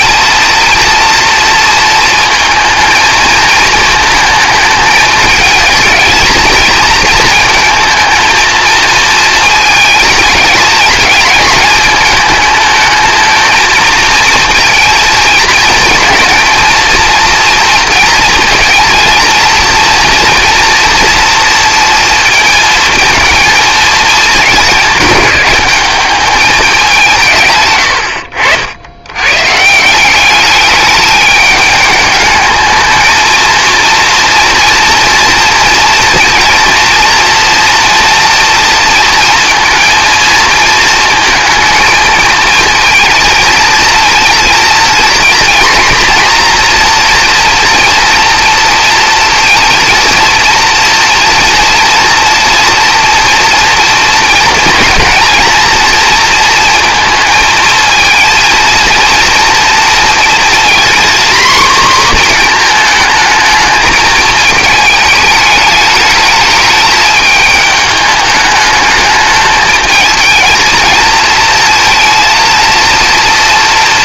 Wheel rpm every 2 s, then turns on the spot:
230, 220, 220, 230, 230, 220, 220, 230, 230, 230, 230, 230, 210, 190, 90, 210, 220, 230, 230, 230, 220, 220, 230, 240, 240, 240, 230, 230, 230, 230, 240, 230, 220, 220, 210, 230, 220.
none